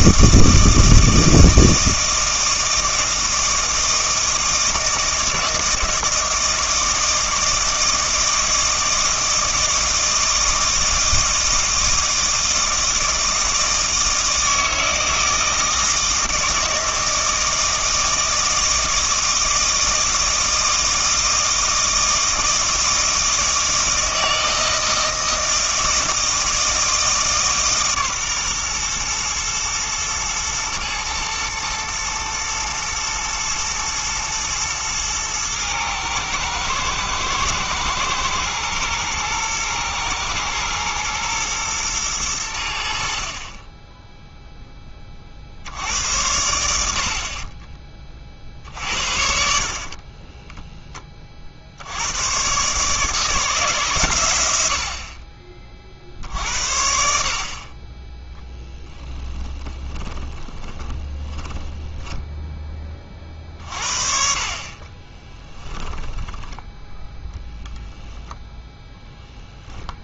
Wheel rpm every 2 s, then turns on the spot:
160, 160, 160, 160, 160, 160, 160, 160, 160, 160, 160, 160, 160, 160, 120, 110, 120, 110, 110, 120, 110, 70, 20, 70, 60, 10, 140, 60, 60, 10, 20, 20, 40, 10, 0.
58-62 64-66